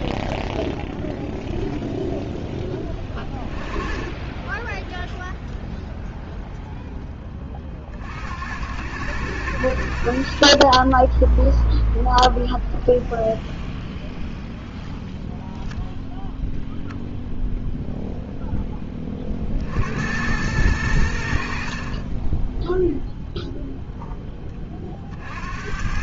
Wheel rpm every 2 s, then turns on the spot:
0, 20, 0, 30, 100, 0, 0, 0, 0, 30, 70, 0, 70.
none